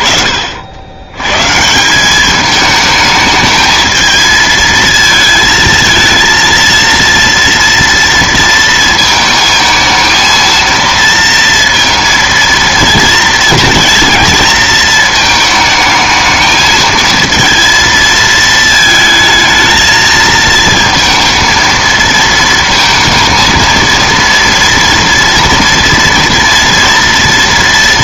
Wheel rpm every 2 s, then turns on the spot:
60, 210, 220, 230, 220, 230, 230, 220, 220, 220, 220, 230, 230, 230.
none